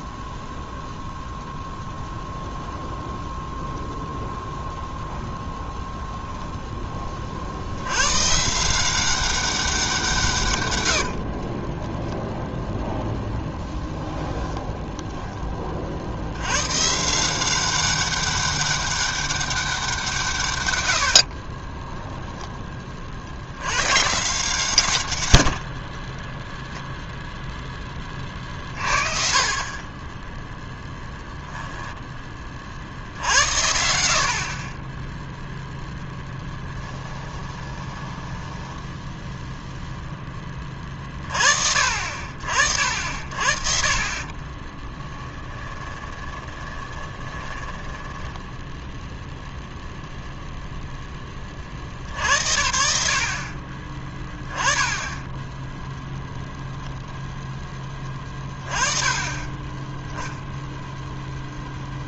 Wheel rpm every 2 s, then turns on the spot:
0, 0, 10, 10, 170, 100, 0, 10, 120, 200, 110, 20, 130, 0, 20, 0, 40, 30, 20, 10, 20, 60, 30, 20, 0, 0, 80, 10, 0, 20, 0.
10-12 14-16 36-40 44-48